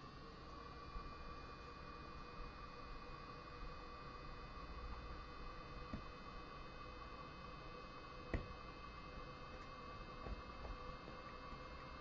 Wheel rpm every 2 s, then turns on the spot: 0, 0, 0, 0, 0, 0.
none